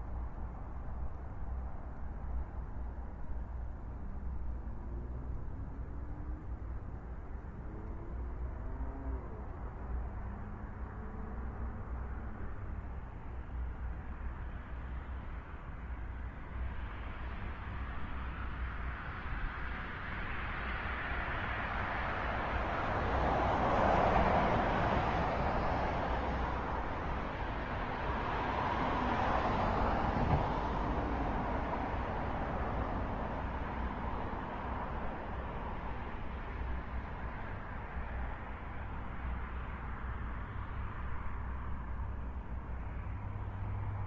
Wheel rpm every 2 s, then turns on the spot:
0, 0, 0, 0, 0, 0, 0, 0, 0, 0, 0, 0, 0, 0, 0, 0, 0, 0, 0, 0, 0, 0.
none